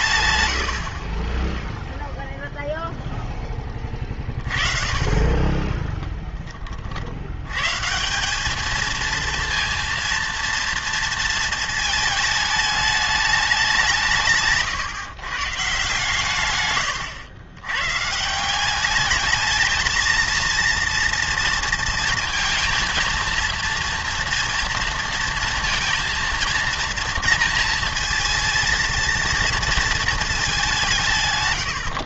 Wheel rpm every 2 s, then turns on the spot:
80, 0, 30, 30, 210, 230, 210, 150, 110, 190, 230, 230, 230, 230, 230, 200.
none